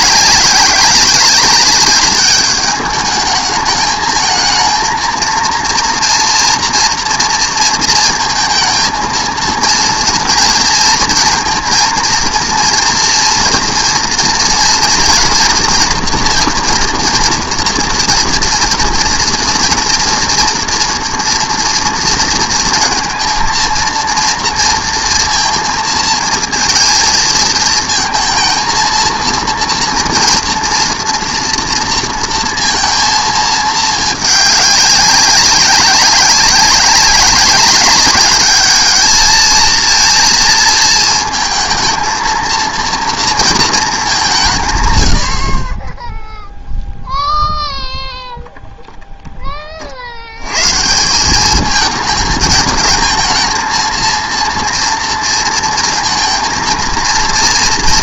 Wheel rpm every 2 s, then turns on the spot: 190, 210, 220, 230, 230, 230, 230, 240, 230, 230, 230, 220, 230, 230, 230, 240, 230, 200, 190, 210, 230, 230, 160, 0, 10, 110, 220, 230, 230.
none